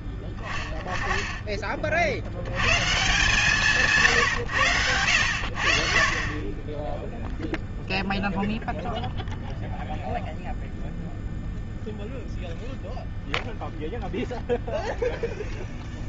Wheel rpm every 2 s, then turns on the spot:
10, 110, 110, 40, 0, 0, 0, 0.
none